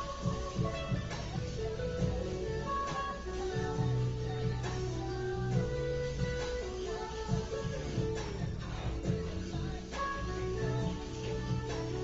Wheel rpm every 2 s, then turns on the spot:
0, 0, 0, 0, 0, 0.
none